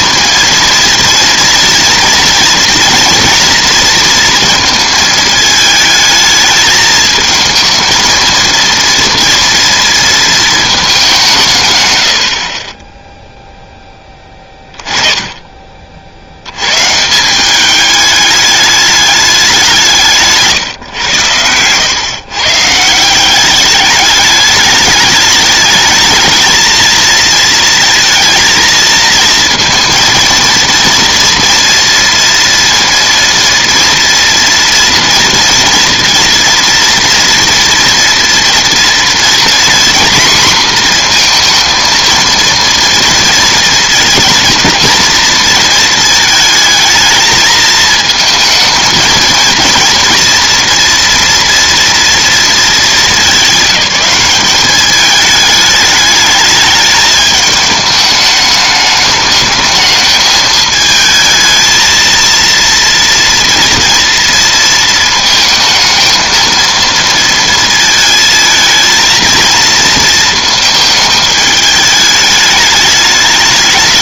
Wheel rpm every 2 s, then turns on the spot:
230, 230, 230, 220, 230, 220, 30, 20, 110, 210, 140, 140, 210, 220, 230, 230, 230, 230, 230, 230, 240, 230, 230, 220, 220, 230, 220, 200, 210, 210, 220, 230, 230, 230, 220, 220, 210.
none